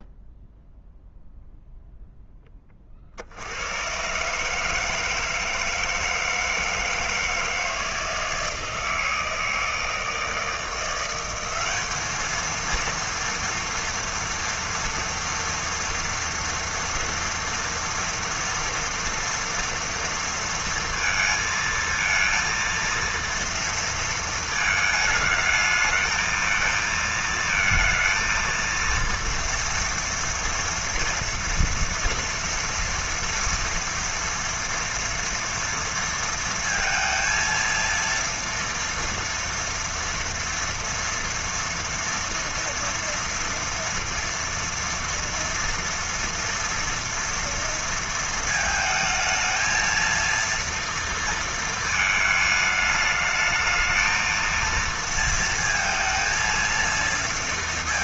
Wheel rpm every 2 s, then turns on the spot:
0, 10, 150, 160, 160, 160, 220, 230, 230, 230, 230, 230, 220, 220, 230, 230, 230, 230, 230, 230, 240, 230, 230, 230, 230, 230, 220, 230, 230.
none